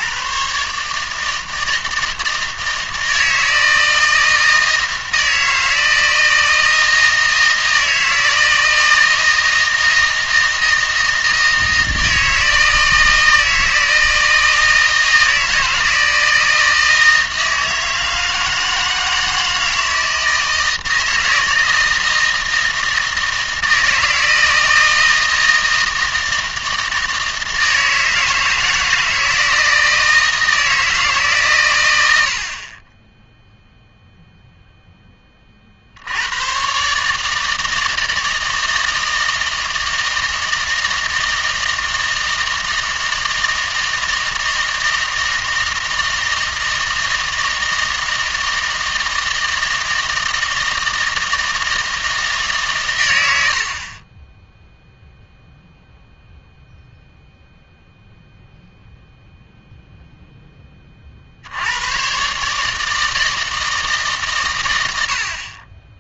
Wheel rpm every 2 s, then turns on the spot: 140, 160, 160, 160, 160, 160, 160, 160, 160, 160, 160, 160, 160, 160, 160, 160, 30, 0, 120, 160, 160, 160, 160, 160, 160, 160, 130, 0, 0, 0, 30, 150, 100.
none